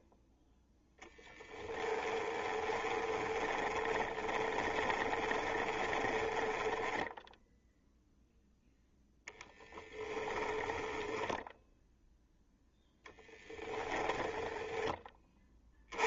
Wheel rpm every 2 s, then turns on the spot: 0, 20, 20, 0, 0, 10, 0, 10.
2-6 10-12